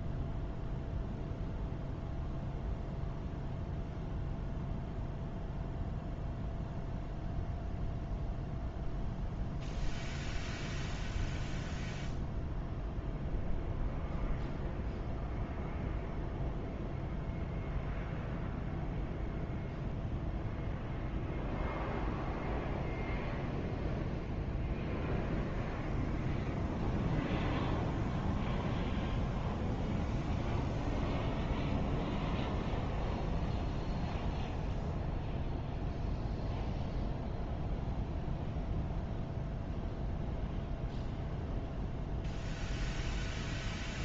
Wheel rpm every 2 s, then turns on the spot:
0, 0, 0, 0, 0, 0, 0, 0, 0, 0, 0, 0, 0, 0, 0, 0, 0, 0, 0, 0, 0, 0.
none